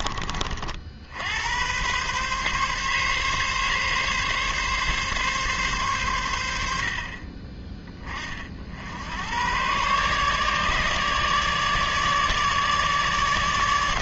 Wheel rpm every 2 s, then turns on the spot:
60, 140, 140, 60, 70, 150, 150.
none